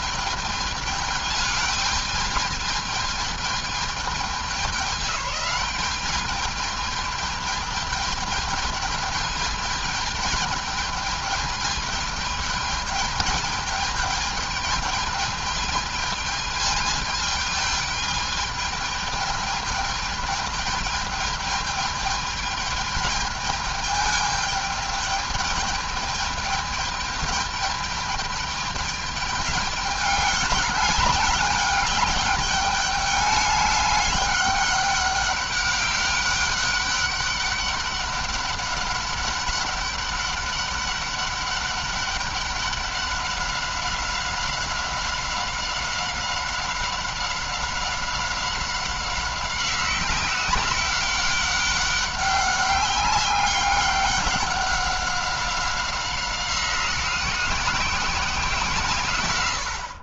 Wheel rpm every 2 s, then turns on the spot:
220, 210, 210, 210, 210, 210, 210, 210, 220, 210, 210, 210, 210, 210, 210, 200, 200, 200, 200, 200, 200, 200, 190, 190, 190, 190, 200, 190, 180, 170.
none